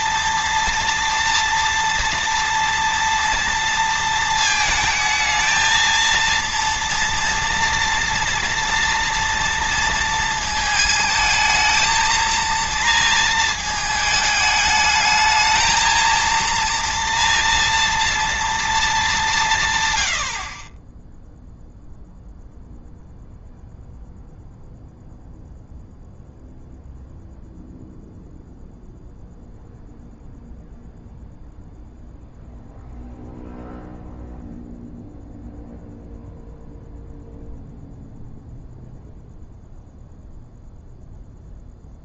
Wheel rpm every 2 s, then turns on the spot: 230, 230, 220, 230, 230, 220, 230, 210, 230, 230, 40, 0, 0, 0, 0, 0, 0, 0, 0, 0, 0.
none